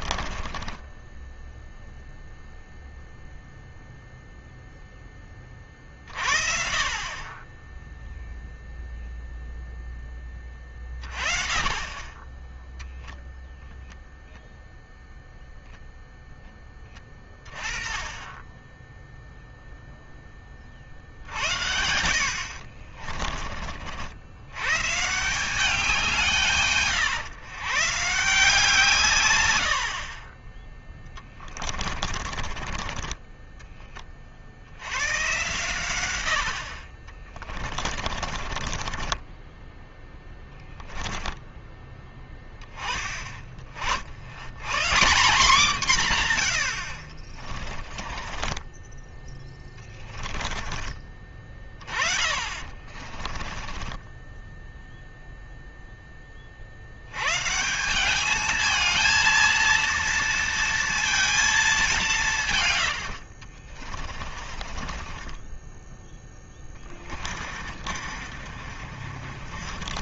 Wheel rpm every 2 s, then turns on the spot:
20, 0, 0, 50, 0, 20, 10, 0, 10, 10, 40, 50, 130, 160, 160, 20, 40, 70, 60, 30, 10, 10, 150, 80, 20, 20, 30, 0, 60, 220, 230, 120, 30, 20, 40.
0-2 12-14 22-24 30-34 38-42 48-54 62-70